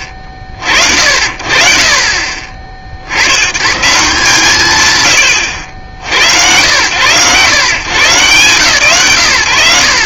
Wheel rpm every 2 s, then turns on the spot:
60, 70, 140, 100, 120.
none